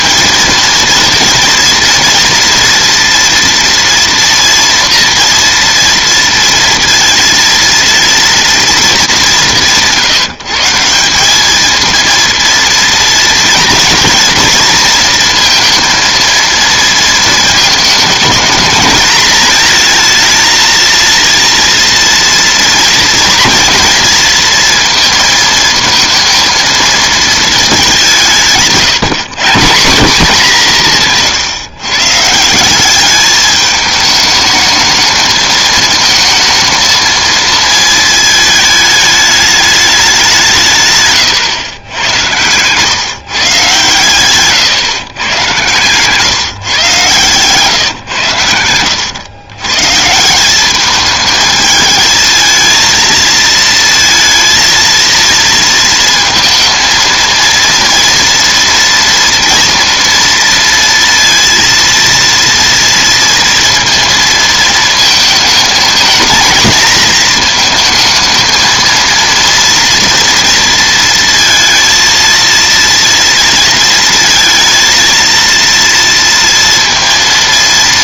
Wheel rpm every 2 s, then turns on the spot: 230, 230, 230, 230, 210, 170, 230, 230, 230, 220, 230, 230, 230, 230, 160, 190, 180, 220, 220, 220, 170, 120, 130, 140, 100, 200, 220, 230, 230, 230, 230, 230, 230, 230, 230, 230, 230, 230, 230.
28-30